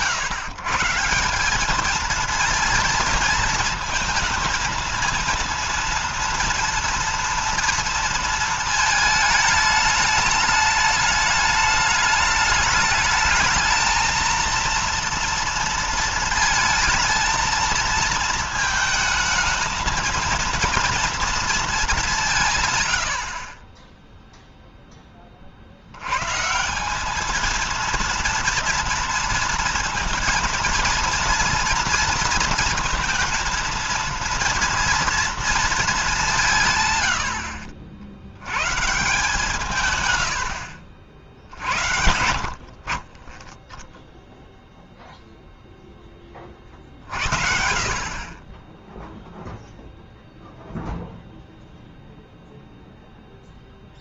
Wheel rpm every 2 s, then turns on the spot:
160, 230, 230, 230, 220, 210, 210, 230, 220, 220, 230, 140, 0, 160, 230, 230, 220, 230, 150, 130, 80, 50, 0, 30, 20, 0, 0.
none